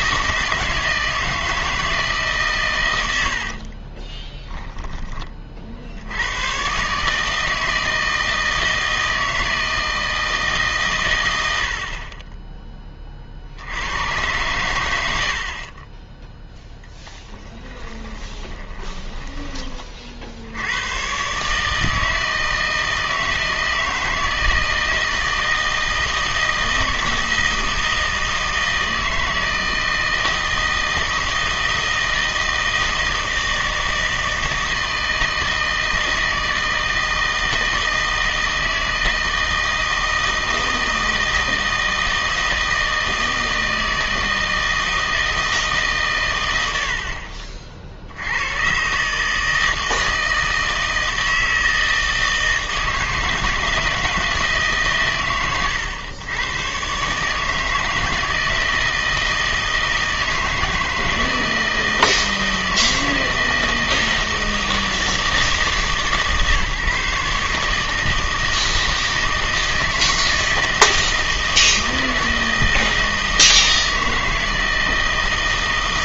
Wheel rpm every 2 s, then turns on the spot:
160, 140, 20, 120, 160, 160, 20, 110, 0, 10, 80, 160, 160, 160, 160, 160, 160, 160, 160, 160, 160, 160, 160, 90, 110, 160, 160, 150, 120, 160, 160, 160, 160, 150, 160, 160, 160, 160.
4-6 18-20